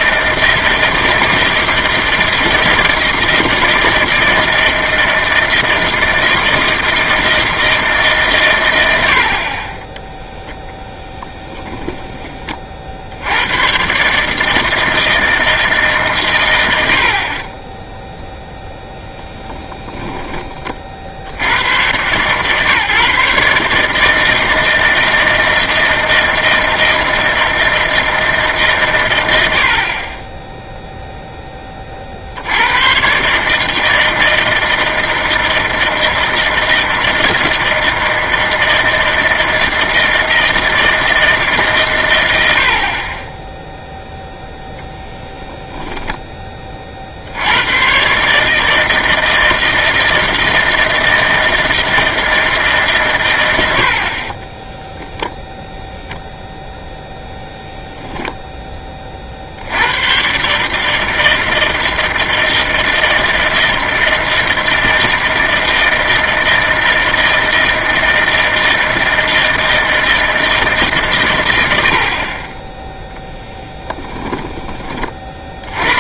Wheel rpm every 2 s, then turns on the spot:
160, 160, 160, 160, 90, 10, 60, 160, 70, 10, 30, 140, 160, 160, 130, 0, 100, 160, 160, 160, 160, 60, 0, 40, 160, 160, 150, 10, 0, 20, 150, 160, 160, 160, 160, 150, 10, 30.
54-56